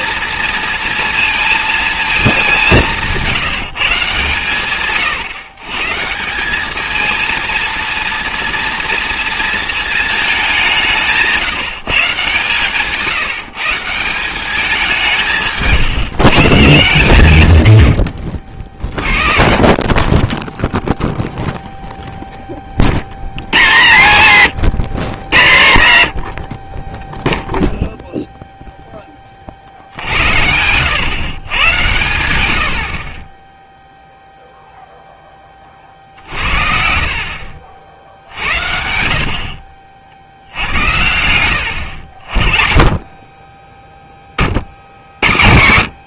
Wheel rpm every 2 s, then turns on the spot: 230, 180, 130, 210, 230, 190, 150, 190, 170, 60, 0, 30, 120, 20, 0, 80, 80, 0, 60, 80, 70, 40, 70.
none